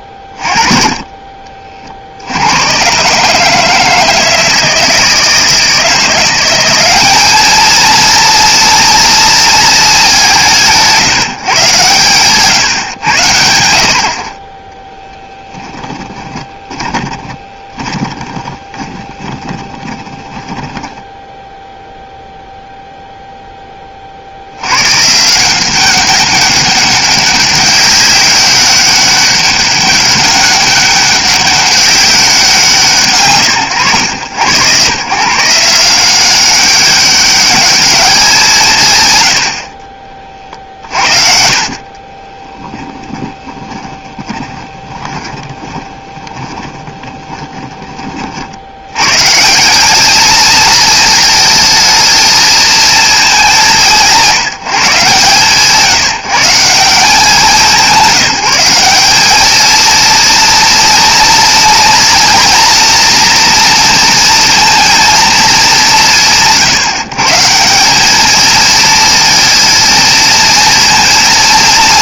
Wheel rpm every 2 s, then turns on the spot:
30, 120, 160, 190, 230, 170, 120, 10, 20, 20, 10, 0, 100, 200, 200, 200, 180, 100, 190, 160, 60, 10, 20, 20, 80, 230, 230, 160, 160, 190, 240, 230, 230, 160, 220, 230.
16-22 42-48